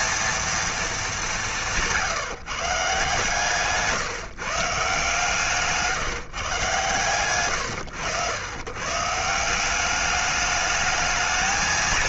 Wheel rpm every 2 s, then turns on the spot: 230, 150, 150, 130, 120, 210.
none